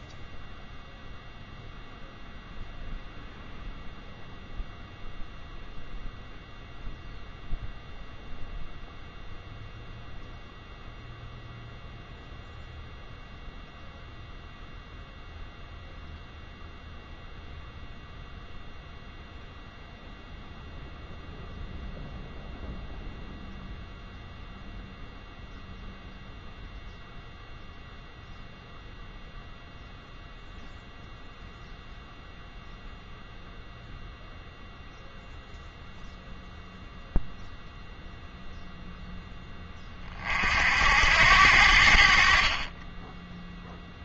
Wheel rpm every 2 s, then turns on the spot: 0, 0, 0, 0, 0, 0, 0, 0, 0, 0, 0, 0, 0, 0, 0, 0, 0, 0, 0, 0, 60, 30.
none